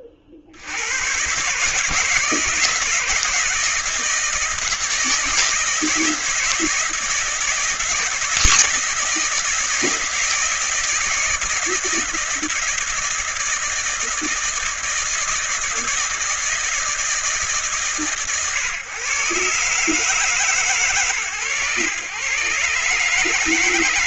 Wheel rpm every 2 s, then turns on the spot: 100, 160, 160, 160, 160, 160, 160, 160, 160, 130, 150, 130.
none